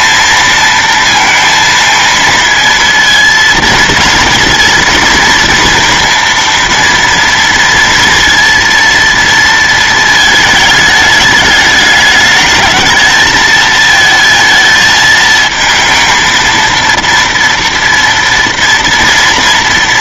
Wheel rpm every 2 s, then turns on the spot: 230, 230, 230, 230, 230, 220, 220, 220, 230, 240.
none